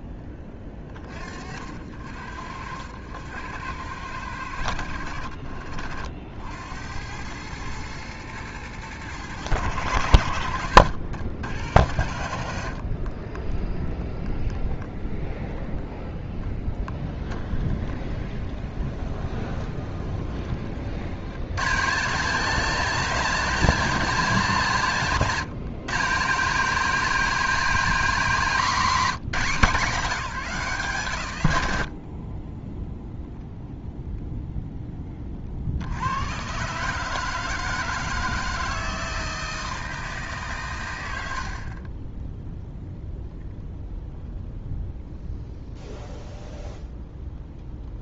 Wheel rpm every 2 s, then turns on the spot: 20, 90, 70, 90, 110, 90, 40, 0, 10, 30, 60, 230, 200, 210, 230, 160, 10, 10, 150, 160, 130, 0, 0, 0.
10-12 16-20